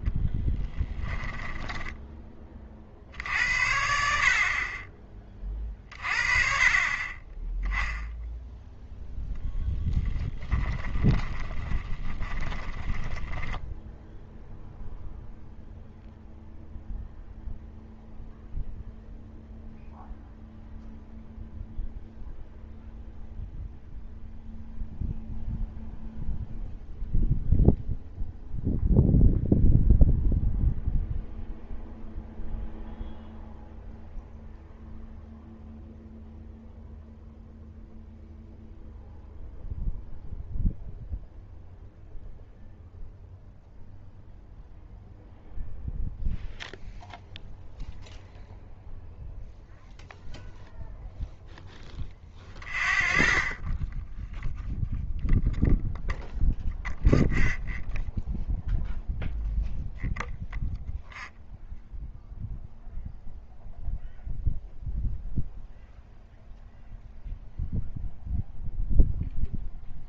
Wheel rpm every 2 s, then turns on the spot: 10, 30, 30, 30, 0, 20, 10, 0, 0, 0, 0, 0, 0, 0, 0, 0, 0, 0, 0, 0, 0, 0, 0, 0, 0, 0, 0, 0, 0, 0, 0, 0, 0, 0, 0.
0-2 10-14